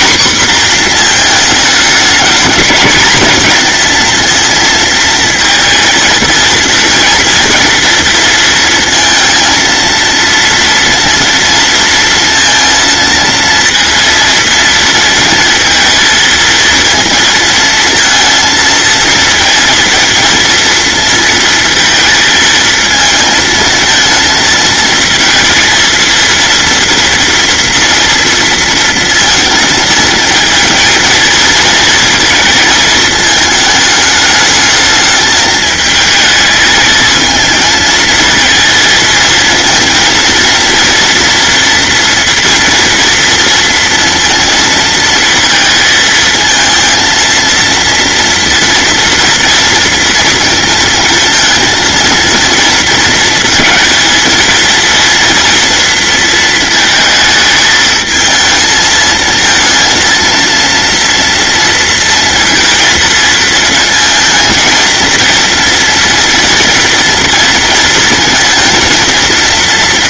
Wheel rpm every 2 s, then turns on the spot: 240, 230, 230, 230, 230, 230, 230, 230, 230, 230, 230, 220, 230, 230, 230, 230, 220, 220, 220, 230, 230, 230, 230, 230, 230, 230, 230, 230, 230, 220, 230, 230, 230, 230, 230.
none